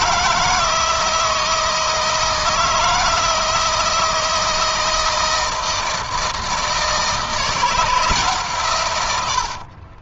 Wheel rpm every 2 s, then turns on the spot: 160, 160, 160, 160, 120.
none